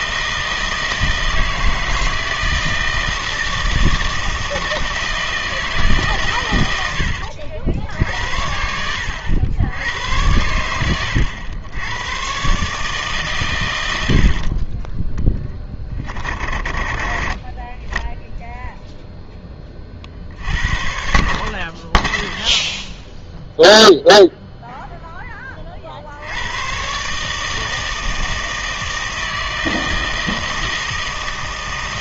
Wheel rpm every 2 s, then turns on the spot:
160, 160, 160, 90, 70, 100, 140, 30, 30, 0, 60, 0, 0, 120, 160, 160.
none